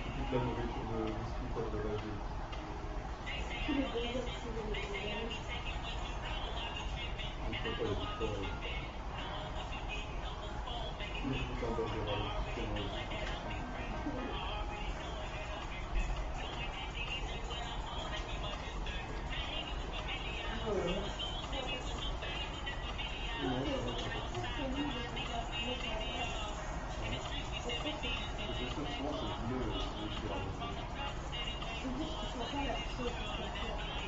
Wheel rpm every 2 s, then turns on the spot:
0, 0, 0, 0, 0, 0, 0, 0, 0, 0, 0, 0, 0, 0, 0, 0, 0.
none